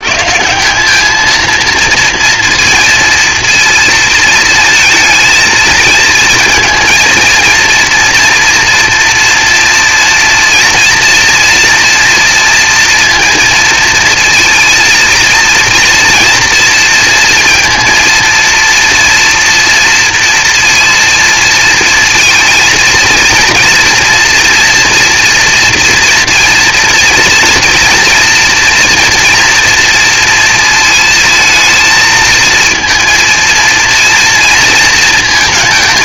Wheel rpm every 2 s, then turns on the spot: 180, 230, 230, 230, 240, 230, 230, 230, 230, 230, 230, 230, 240, 230, 230, 230, 230, 230.
none